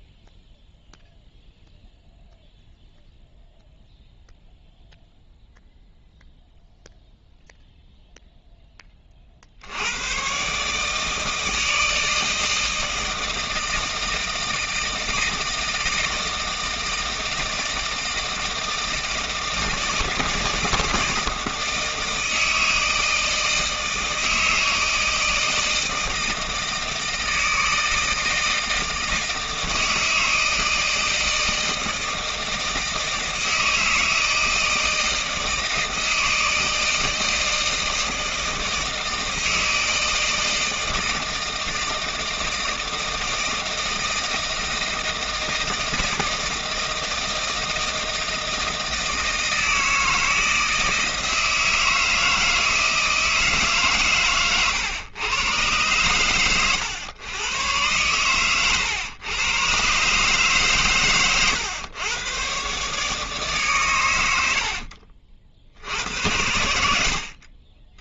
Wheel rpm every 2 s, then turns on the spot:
0, 0, 0, 0, 10, 150, 160, 160, 160, 160, 160, 160, 160, 160, 160, 160, 160, 160, 160, 160, 160, 160, 160, 160, 160, 160, 160, 130, 110, 120, 140, 130, 60, 70.
64-66